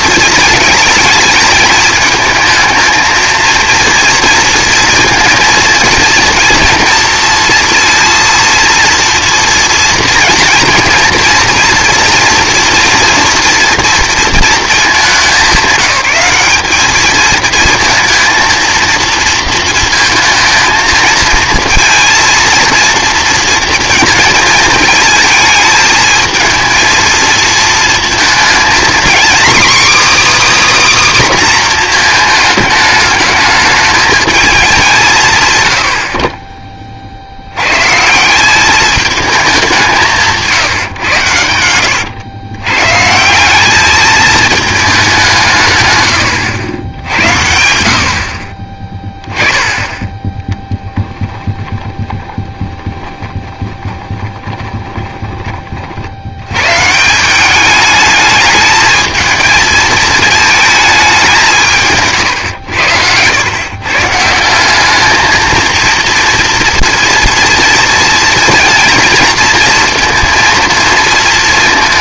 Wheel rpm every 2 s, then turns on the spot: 220, 220, 230, 230, 230, 230, 240, 220, 200, 230, 220, 230, 220, 220, 240, 300, 220, 200, 30, 200, 150, 120, 210, 90, 20, 10, 20, 20, 120, 220, 210, 100, 190, 230, 230, 230.
50-56